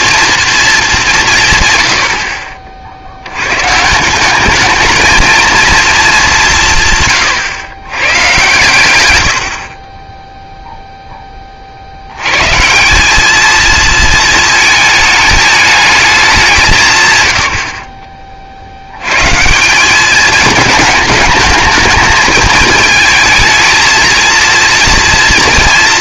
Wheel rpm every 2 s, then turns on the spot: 230, 50, 210, 160, 120, 0, 140, 220, 170, 60, 220, 220, 230.
none